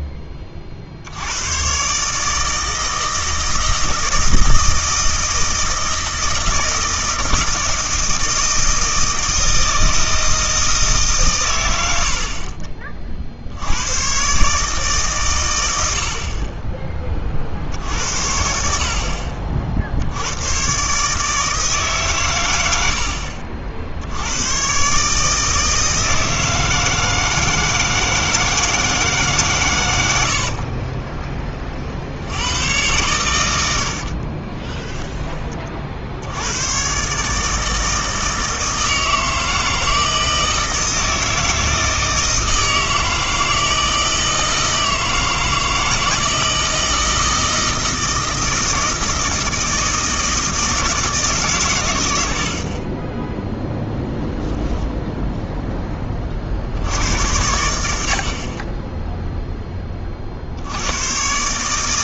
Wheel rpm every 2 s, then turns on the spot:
30, 160, 160, 160, 160, 160, 40, 150, 40, 60, 110, 100, 110, 160, 160, 60, 90, 30, 100, 160, 160, 160, 160, 160, 160, 160, 60, 0, 60, 20, 70.
30-32 34-36